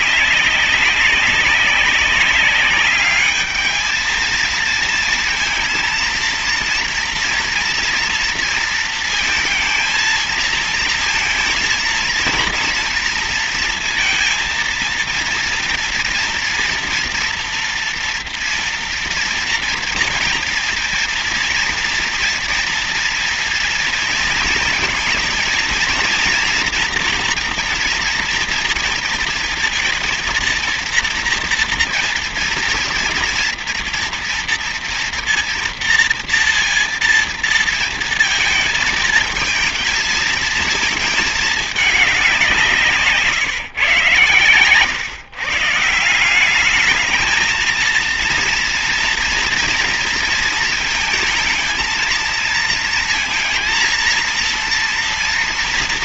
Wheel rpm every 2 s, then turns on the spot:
190, 200, 220, 230, 230, 230, 230, 230, 230, 230, 230, 230, 230, 230, 230, 230, 230, 230, 230, 220, 220, 180, 120, 180, 230, 230, 230, 230.
none